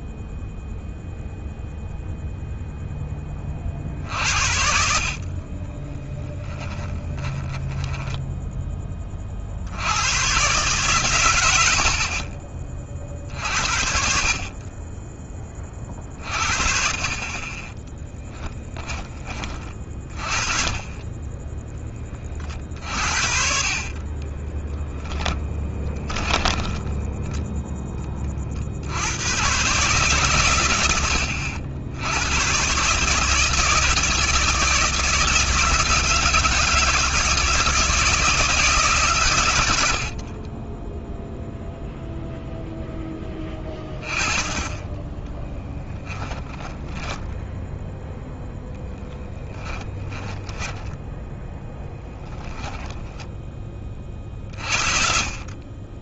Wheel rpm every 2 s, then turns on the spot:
0, 10, 40, 10, 30, 120, 50, 30, 40, 20, 20, 60, 10, 10, 80, 100, 140, 160, 160, 130, 10, 10, 10, 10, 0, 10, 10, 40.
4-8 22-28 40-42 50-52